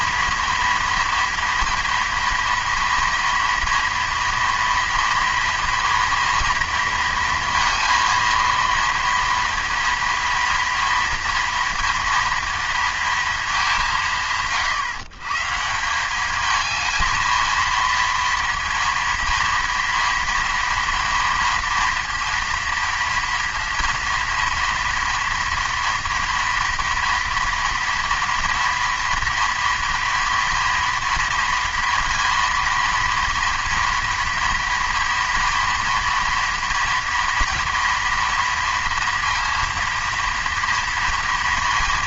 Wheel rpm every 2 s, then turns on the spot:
230, 230, 230, 230, 230, 230, 230, 130, 220, 230, 230, 230, 230, 230, 230, 230, 230, 230, 230, 230, 230.
none